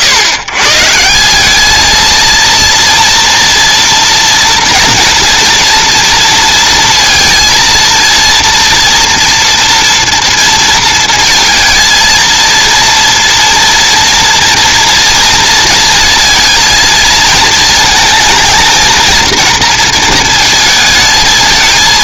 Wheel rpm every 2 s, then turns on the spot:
130, 230, 230, 230, 240, 230, 230, 240, 220, 230, 220.
none